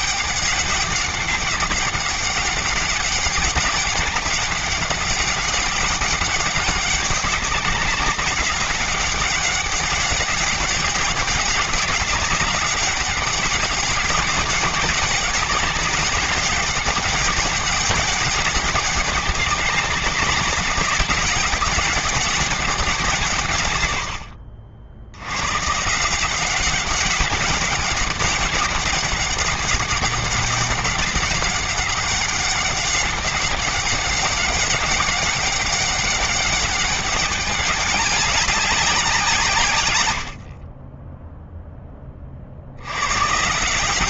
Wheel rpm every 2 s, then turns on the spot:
200, 190, 200, 200, 200, 190, 190, 200, 190, 200, 200, 160, 90, 190, 200, 200, 200, 200, 200, 170, 10, 100.
none